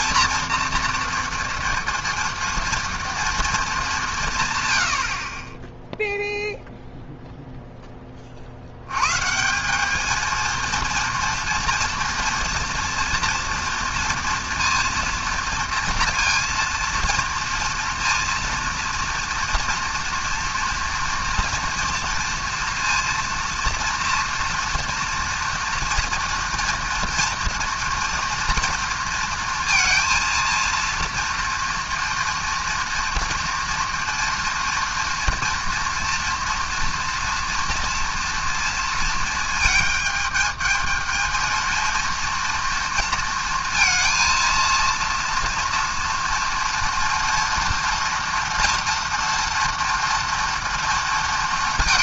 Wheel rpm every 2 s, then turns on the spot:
230, 230, 40, 0, 150, 230, 230, 230, 230, 230, 240, 240, 230, 230, 230, 230, 230, 230, 230, 220, 220, 230, 230, 230, 230, 230.
none